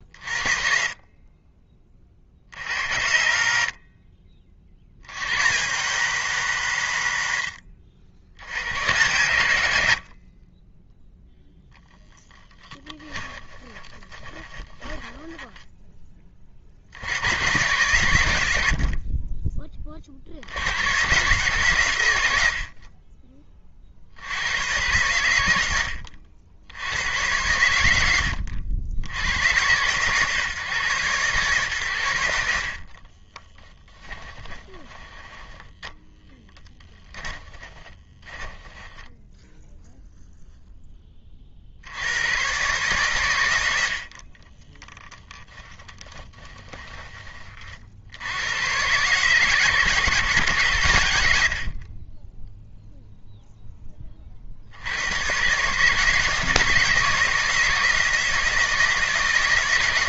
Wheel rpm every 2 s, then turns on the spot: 40, 80, 70, 120, 100, 10, 10, 20, 60, 50, 100, 60, 110, 90, 70, 130, 50, 20, 10, 10, 10, 130, 10, 20, 120, 110, 0, 80, 160, 160.
0-2 12-16 32-40 44-48